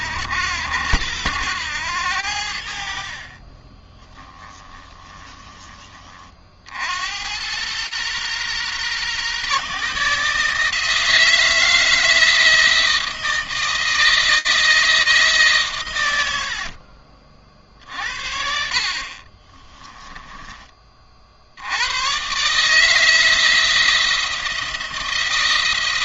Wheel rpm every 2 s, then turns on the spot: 80, 60, 10, 70, 120, 160, 160, 160, 50, 60, 30, 150, 170.
4-6 18-20